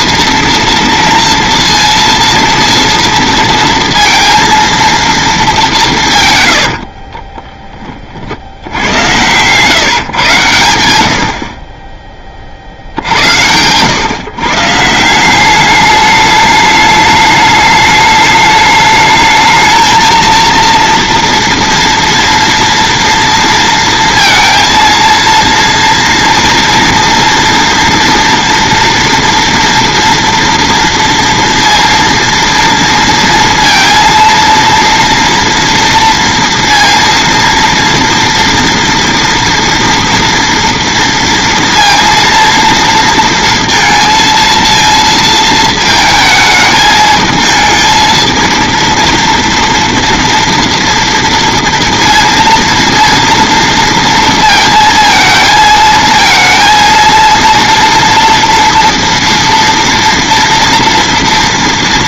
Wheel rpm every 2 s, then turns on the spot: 230, 230, 230, 80, 70, 120, 40, 150, 210, 210, 230, 240, 230, 230, 230, 230, 230, 230, 230, 230, 230, 230, 230, 220, 230, 230, 230, 230, 230, 240, 230.
6-10